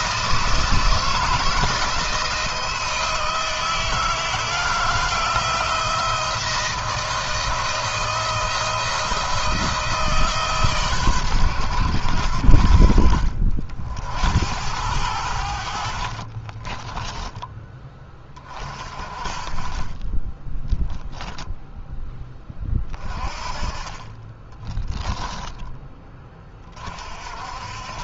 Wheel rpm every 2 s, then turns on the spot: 160, 160, 170, 160, 160, 130, 60, 80, 20, 30, 0, 20, 10, 30.
16-18 24-26